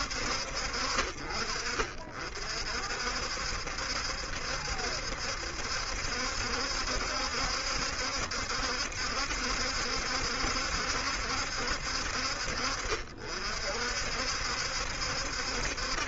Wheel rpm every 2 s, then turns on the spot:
50, 60, 70, 70, 70, 60, 60, 70.
none